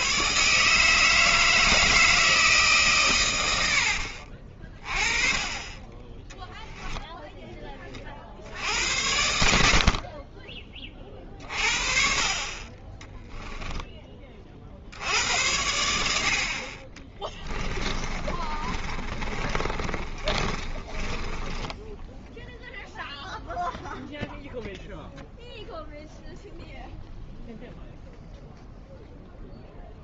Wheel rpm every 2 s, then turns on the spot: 160, 150, 20, 0, 80, 30, 20, 60, 30, 30, 30, 0, 0, 0, 0.
18-22